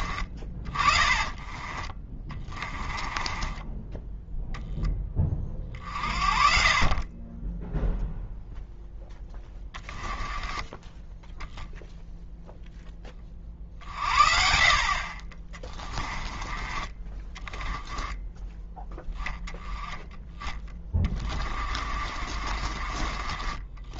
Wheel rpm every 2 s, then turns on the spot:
30, 20, 10, 40, 0, 10, 10, 40, 20, 10, 20, 40.
0-4 10-12 20-24